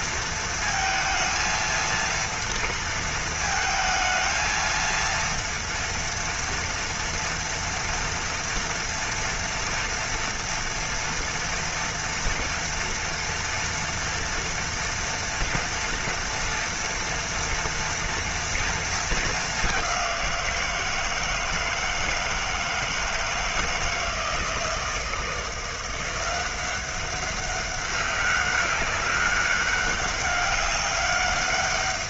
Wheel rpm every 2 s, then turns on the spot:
230, 230, 220, 230, 230, 230, 240, 230, 230, 230, 170, 160, 160, 190, 200, 200.
none